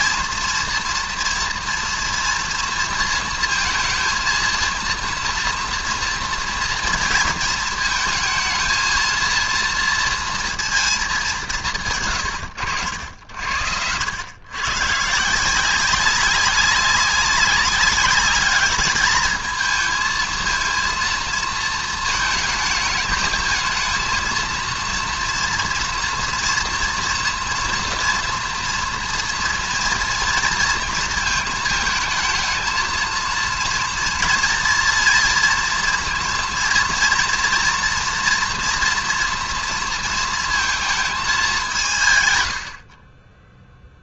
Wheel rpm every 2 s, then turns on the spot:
230, 230, 230, 230, 220, 230, 90, 120, 200, 210, 230, 220, 230, 230, 230, 230, 220, 230, 230, 240, 230, 100.
none